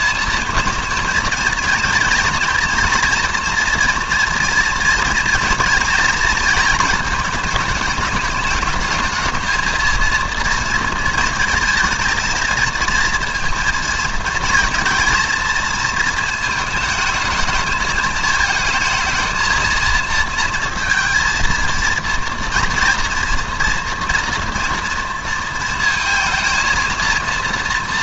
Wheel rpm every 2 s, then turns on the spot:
230, 230, 230, 230, 210, 220, 230, 230, 220, 220, 230, 240, 230, 230.
none